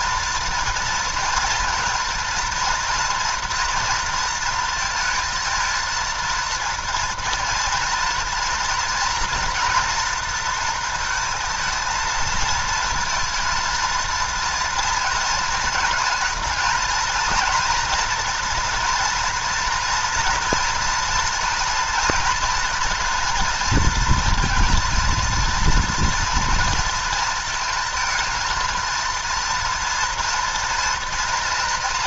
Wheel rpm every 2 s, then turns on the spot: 230, 230, 230, 230, 240, 230, 220, 230, 230, 240, 230, 240, 230, 230, 230, 230.
none